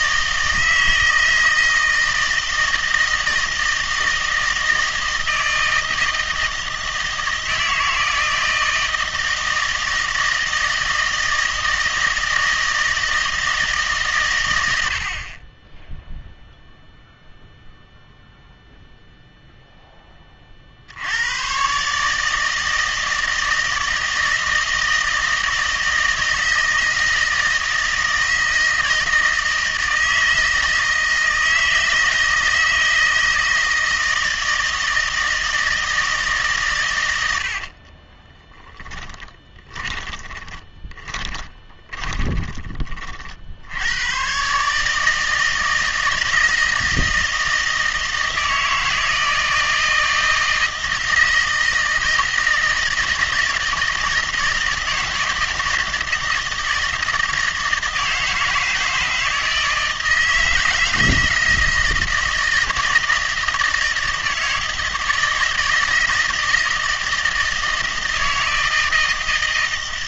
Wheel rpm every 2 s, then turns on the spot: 160, 160, 160, 160, 160, 160, 160, 70, 0, 0, 70, 160, 160, 160, 160, 160, 160, 160, 120, 10, 20, 30, 150, 160, 160, 160, 160, 160, 160, 160, 160, 160, 160, 160, 160.
38-42